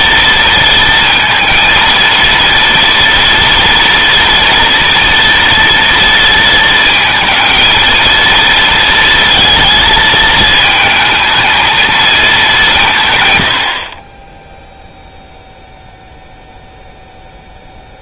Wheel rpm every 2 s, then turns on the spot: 230, 230, 230, 230, 230, 220, 180, 0, 0.
none